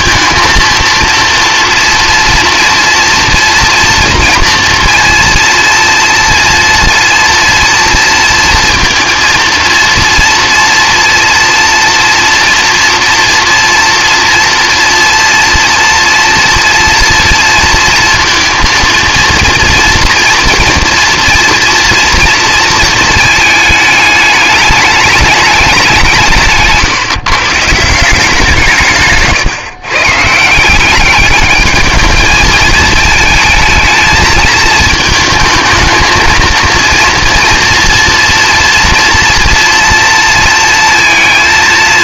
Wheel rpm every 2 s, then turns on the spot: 230, 230, 230, 230, 220, 230, 230, 240, 230, 230, 230, 230, 210, 160, 150, 180, 220, 220, 230, 230, 230.
none